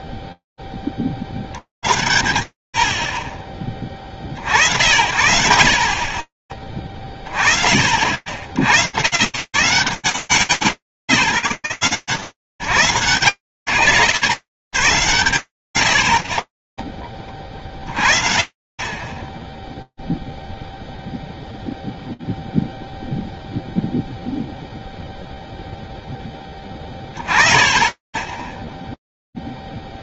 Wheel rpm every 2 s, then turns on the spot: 50, 30, 50, 120, 90, 110, 20, 40, 0, 0, 0, 20, 0, 0, 100.
none